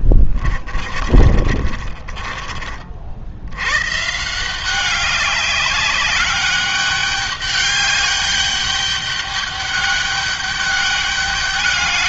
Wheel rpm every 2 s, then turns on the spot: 40, 50, 180, 200, 200, 200.
0-2